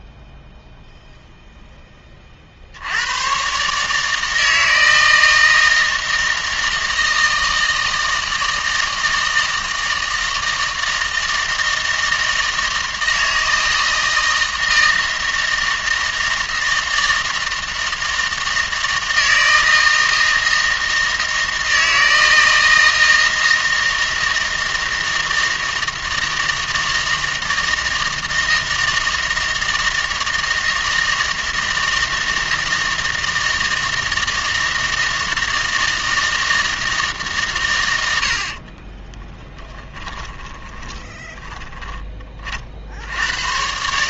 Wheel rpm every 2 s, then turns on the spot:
0, 70, 160, 160, 160, 160, 160, 160, 160, 160, 160, 160, 160, 160, 160, 160, 160, 160, 160, 30, 10, 50.
38-42